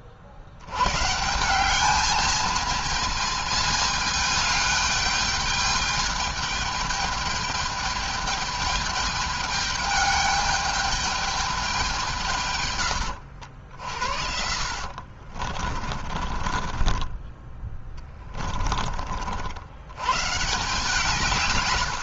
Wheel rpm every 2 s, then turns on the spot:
110, 220, 210, 210, 210, 210, 110, 70, 30, 30, 150.
14-18